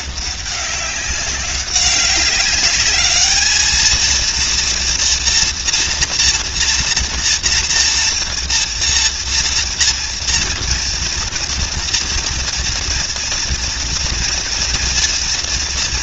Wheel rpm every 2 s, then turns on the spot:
200, 200, 230, 230, 230, 230, 240, 230.
none